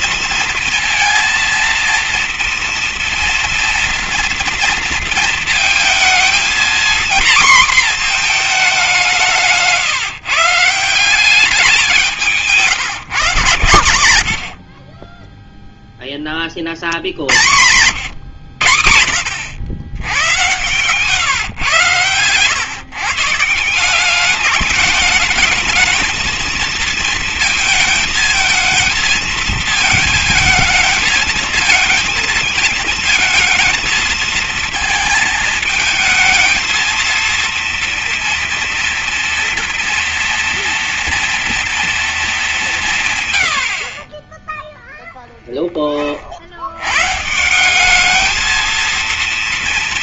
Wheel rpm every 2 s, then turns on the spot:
230, 230, 230, 250, 180, 180, 140, 30, 40, 90, 130, 140, 210, 230, 220, 220, 220, 220, 220, 230, 230, 130, 0, 120, 230.
none